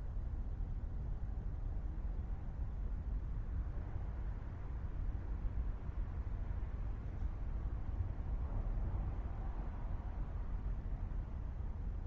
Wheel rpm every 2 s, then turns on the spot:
0, 0, 0, 0, 0, 0.
none